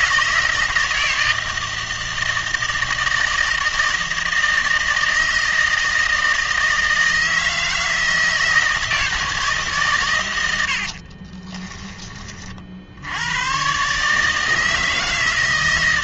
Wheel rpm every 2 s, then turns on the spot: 160, 160, 160, 160, 160, 80, 50, 160.
none